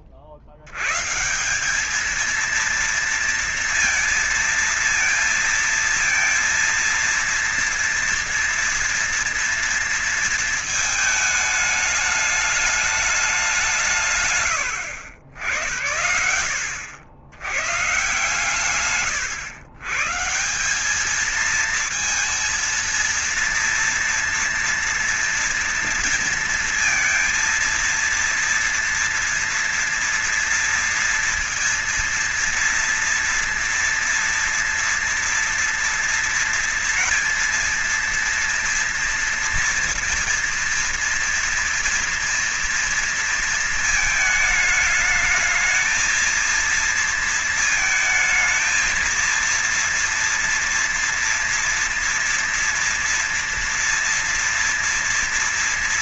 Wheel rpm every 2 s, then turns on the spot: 50, 220, 220, 230, 230, 220, 210, 110, 80, 130, 180, 230, 230, 230, 230, 230, 230, 240, 230, 230, 230, 230, 220, 230, 230, 230, 230, 230.
none